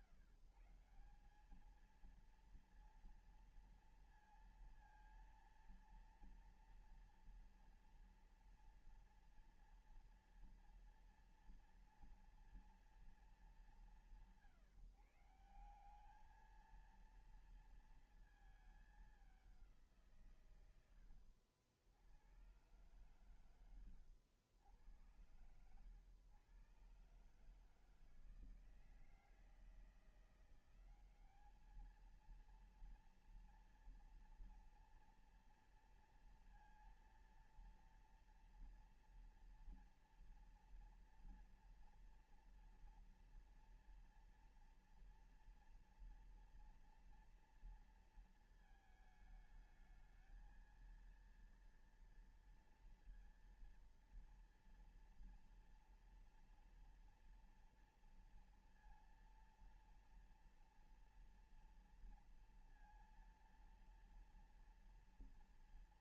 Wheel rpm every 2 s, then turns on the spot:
150, 230, 230, 230, 230, 230, 240, 160, 210, 220, 140, 90, 90, 120, 160, 170, 220, 230, 230, 230, 230, 230, 230, 230, 230, 220, 230, 230, 230, 230, 230, 240, 230.
none